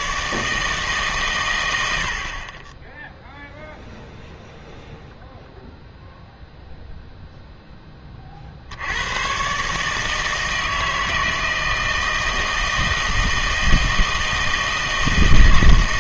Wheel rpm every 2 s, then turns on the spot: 150, 20, 0, 0, 70, 160, 160, 160.
none